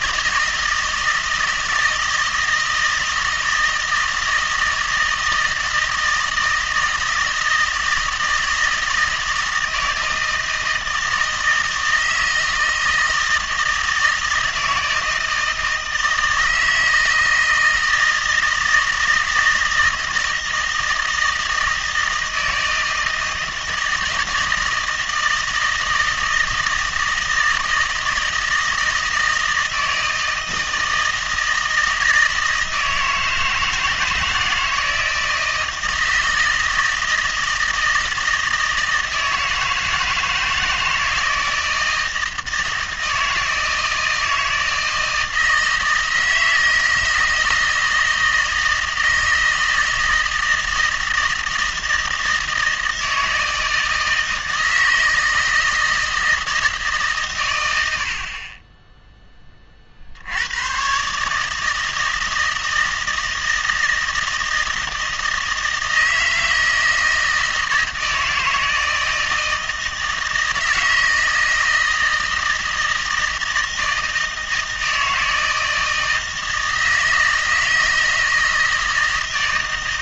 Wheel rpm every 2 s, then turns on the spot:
160, 160, 160, 160, 170, 160, 160, 160, 160, 160, 160, 160, 160, 160, 160, 160, 160, 160, 160, 160, 160, 160, 160, 160, 160, 160, 160, 160, 160, 20, 100, 160, 160, 160, 160, 160, 160, 160, 160, 160.
none